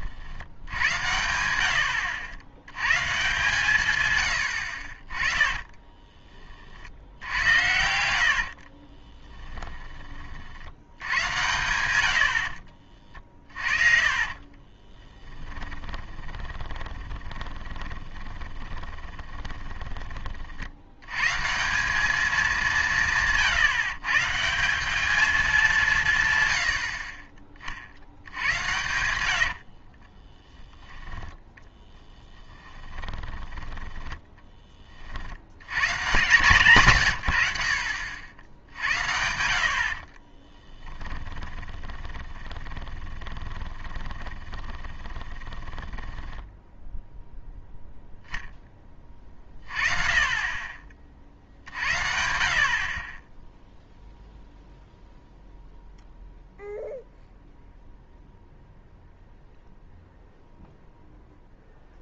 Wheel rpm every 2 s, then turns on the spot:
90, 110, 50, 50, 40, 80, 40, 20, 20, 20, 80, 180, 180, 80, 120, 10, 10, 30, 130, 80, 10, 20, 20, 0, 20, 40, 40, 0, 0, 0, 0.
8-10 12-20 32-34 40-46